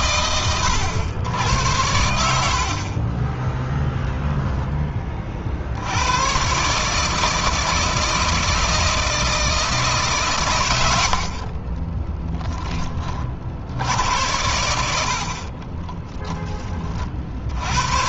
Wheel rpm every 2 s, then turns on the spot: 90, 40, 20, 150, 160, 80, 30, 60, 40.
none